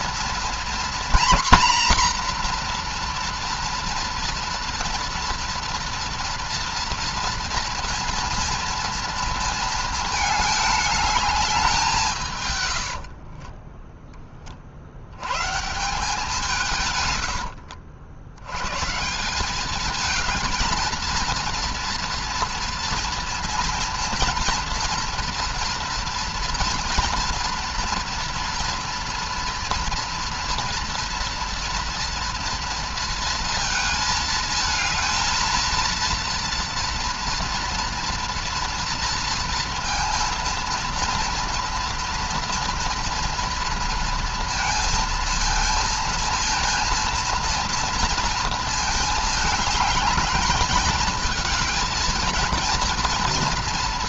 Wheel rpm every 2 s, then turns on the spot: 240, 240, 230, 230, 230, 210, 100, 40, 140, 130, 230, 230, 240, 230, 230, 230, 230, 220, 230, 240, 230, 230, 230, 230, 220, 210, 230.
12-14